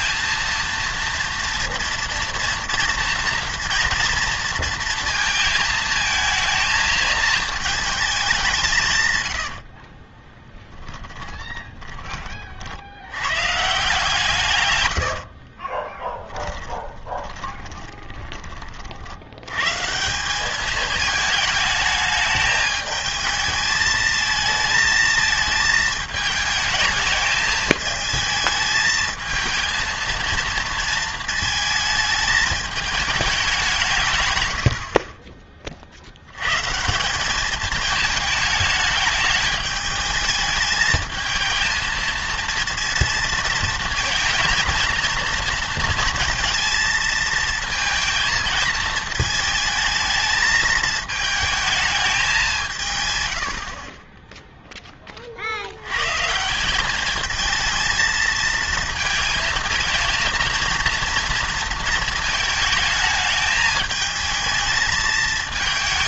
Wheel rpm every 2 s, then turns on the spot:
230, 230, 230, 220, 170, 10, 60, 120, 10, 30, 210, 210, 220, 220, 220, 230, 220, 90, 140, 220, 220, 230, 230, 230, 220, 220, 170, 0, 170, 230, 230, 220, 220.
10-12 16-18